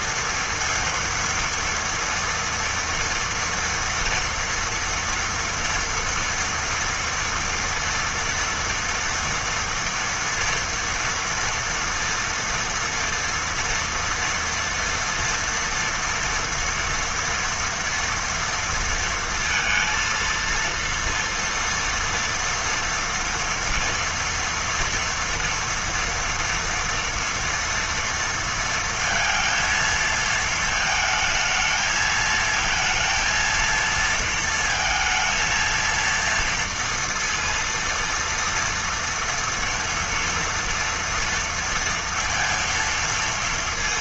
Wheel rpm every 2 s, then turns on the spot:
230, 230, 240, 230, 230, 230, 230, 230, 230, 230, 230, 230, 230, 230, 230, 220, 220, 230, 230, 230, 240, 230.
none